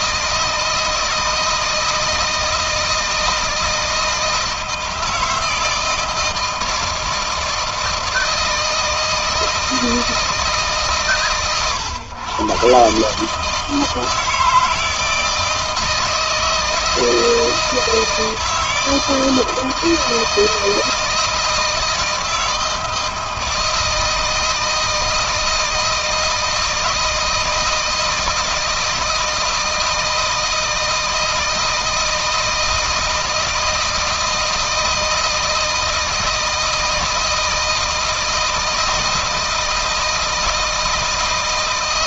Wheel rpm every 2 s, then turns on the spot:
160, 160, 160, 160, 160, 130, 130, 160, 160, 160, 160, 160, 160, 160, 160, 160, 160, 160, 160, 160, 160.
none